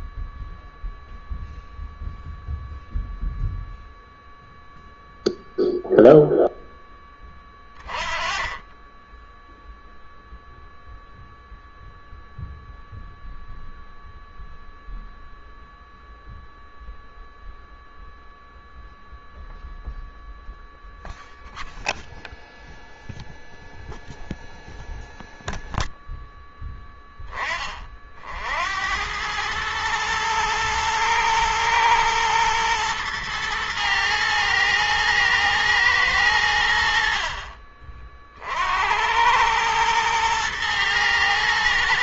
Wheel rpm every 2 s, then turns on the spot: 0, 0, 0, 0, 20, 0, 0, 0, 0, 0, 0, 0, 0, 0, 70, 110, 110, 110, 80, 60, 110.
none